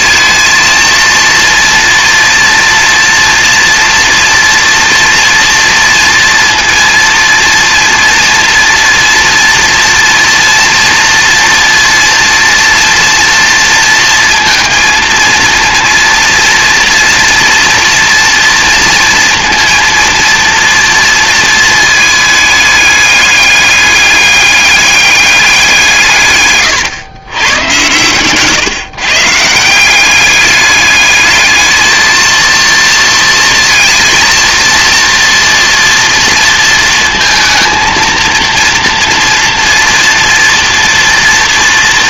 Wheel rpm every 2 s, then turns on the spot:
230, 230, 240, 230, 230, 230, 240, 230, 230, 230, 230, 210, 200, 140, 140, 200, 230, 230, 230, 230, 230.
none